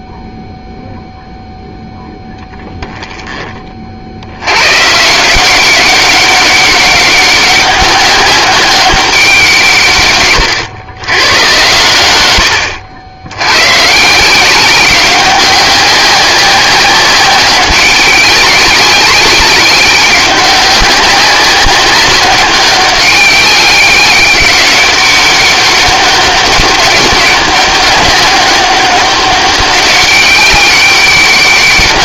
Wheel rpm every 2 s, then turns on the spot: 0, 0, 110, 200, 200, 110, 90, 180, 190, 190, 200, 200, 200, 200, 190, 190.
none